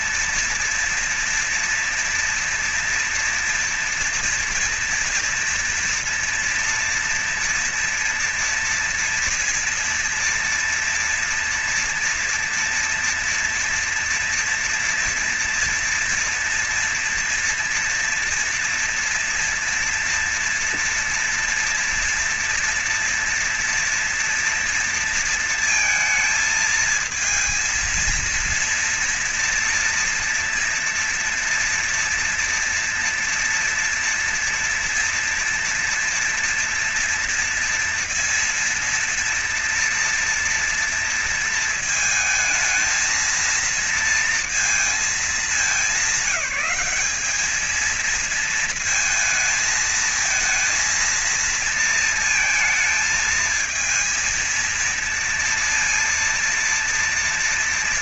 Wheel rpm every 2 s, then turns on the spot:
230, 230, 240, 230, 230, 230, 240, 230, 230, 230, 230, 230, 230, 230, 230, 230, 230, 230, 230, 230, 230, 230, 220, 190, 220, 230, 230, 230, 230.
none